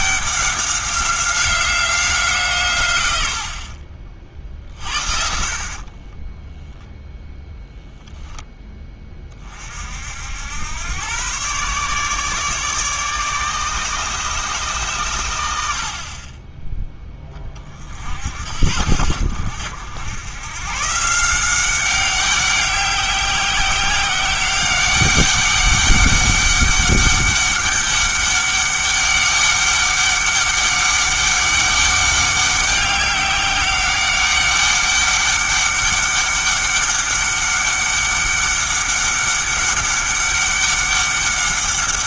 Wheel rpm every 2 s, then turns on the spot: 190, 130, 50, 0, 10, 100, 150, 130, 10, 70, 130, 190, 190, 200, 200, 200, 200, 200, 200, 200, 200.
4-6